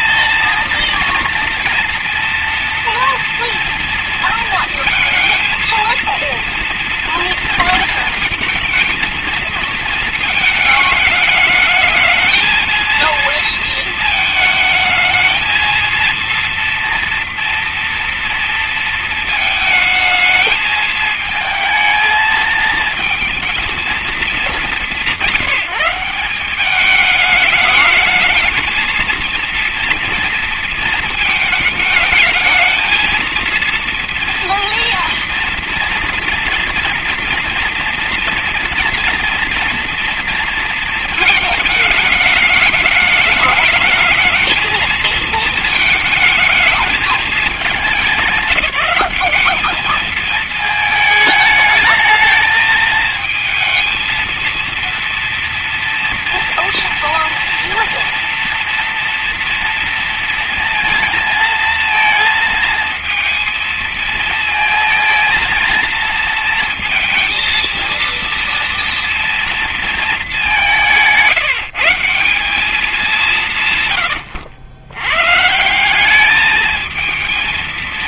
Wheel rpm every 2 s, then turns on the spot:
230, 230, 230, 230, 220, 220, 220, 220, 230, 230, 220, 220, 210, 190, 220, 230, 220, 240, 240, 230, 230, 210, 220, 220, 200, 220, 220, 230, 230, 230, 230, 230, 220, 230, 230, 200, 180, 90, 210.
none